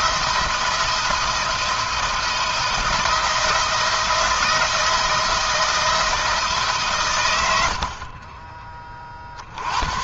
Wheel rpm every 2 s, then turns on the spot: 170, 170, 160, 140, 40.
none